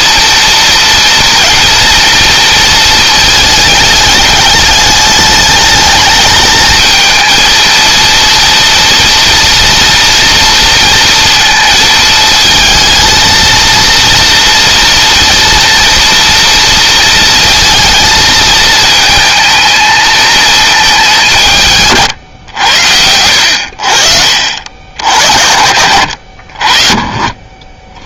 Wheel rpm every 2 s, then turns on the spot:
230, 230, 210, 220, 230, 230, 220, 230, 230, 220, 210, 90, 50, 50.
none